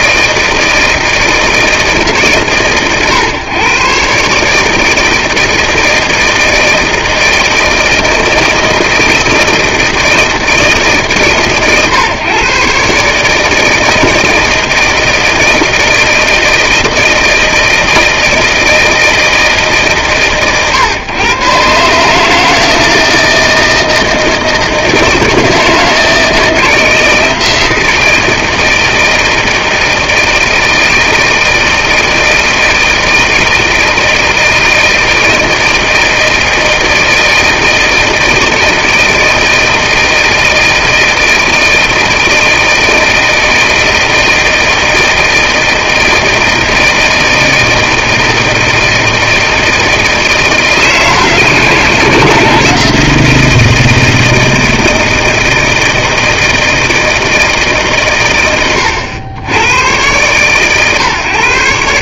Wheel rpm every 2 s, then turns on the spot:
160, 140, 150, 160, 160, 160, 140, 160, 160, 160, 130, 160, 160, 160, 160, 160, 160, 160, 160, 160, 160, 160, 160, 160, 160, 160, 160, 160, 160, 110, 130.
none